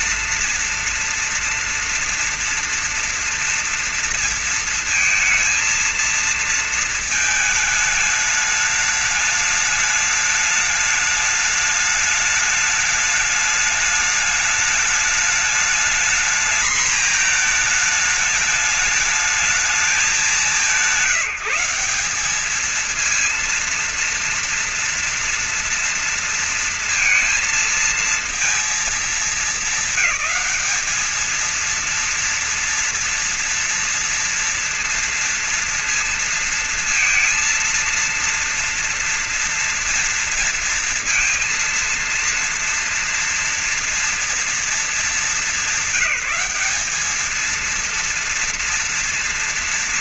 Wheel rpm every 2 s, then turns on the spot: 230, 230, 230, 230, 210, 210, 210, 210, 220, 210, 170, 200, 230, 230, 230, 210, 230, 230, 230, 230, 230, 230, 230, 210, 230.
none